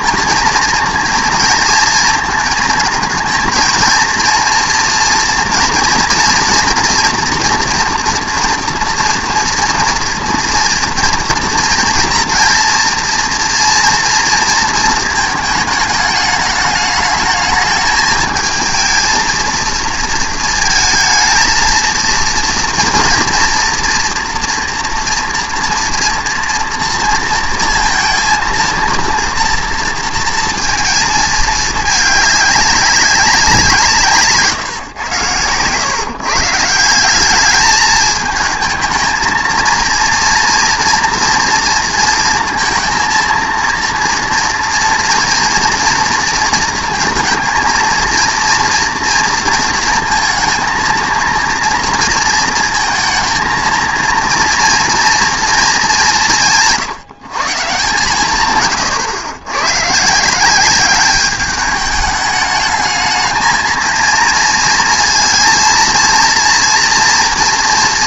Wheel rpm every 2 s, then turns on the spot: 230, 230, 230, 230, 240, 230, 230, 230, 210, 220, 230, 230, 240, 230, 230, 230, 200, 140, 150, 220, 230, 230, 230, 230, 230, 230, 230, 230, 180, 130, 180, 210, 230, 230.
none